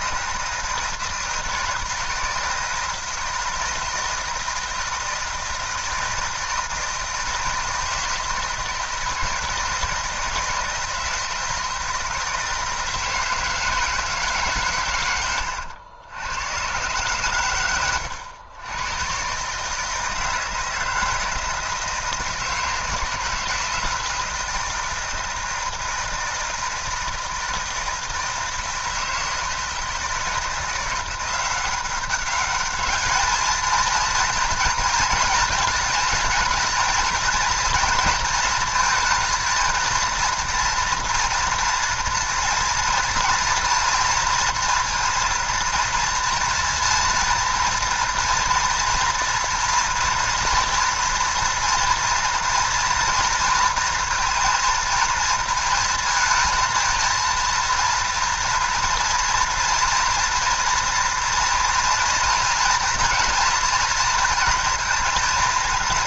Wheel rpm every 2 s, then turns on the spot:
160, 160, 160, 160, 160, 160, 160, 130, 120, 110, 170, 160, 160, 160, 160, 170, 210, 230, 220, 230, 230, 230, 230, 230, 230, 240, 230, 230, 230, 230, 230, 240, 230.
none